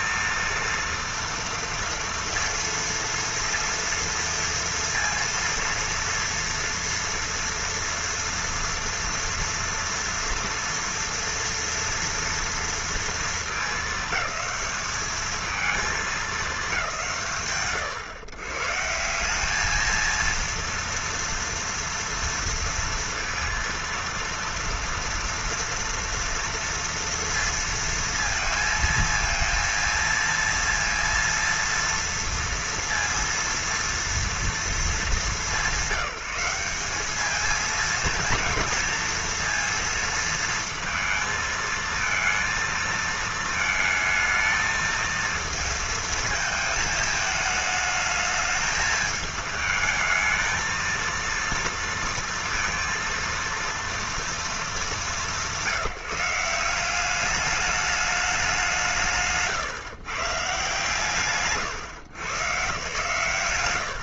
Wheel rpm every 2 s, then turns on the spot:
230, 230, 230, 230, 230, 230, 230, 210, 160, 150, 230, 230, 230, 230, 230, 230, 230, 220, 190, 230, 230, 230, 220, 220, 210, 230, 230, 200, 170, 180, 140, 110.
60-62